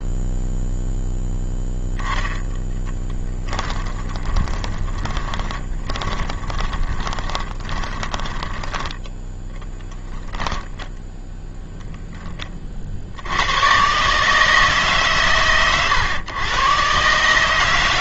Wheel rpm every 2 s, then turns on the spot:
0, 10, 10, 30, 20, 10, 30, 160, 130.
2-10